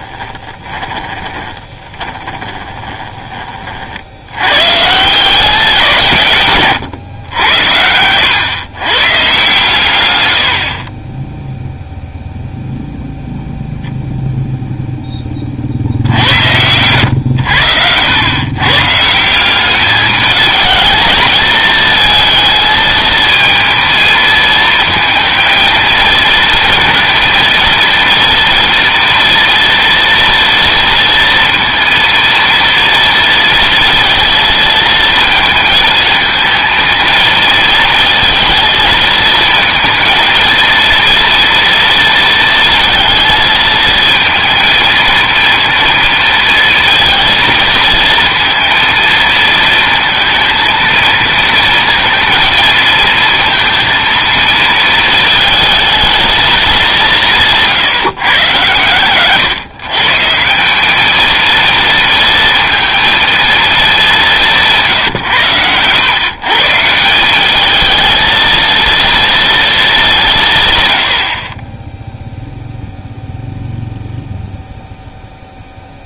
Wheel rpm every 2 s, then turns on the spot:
20, 20, 130, 130, 130, 40, 0, 0, 100, 140, 220, 220, 220, 230, 230, 230, 230, 220, 220, 220, 230, 230, 230, 230, 230, 230, 220, 220, 190, 110, 190, 230, 170, 160, 230, 120, 0, 0.
0-4 10-12 64-66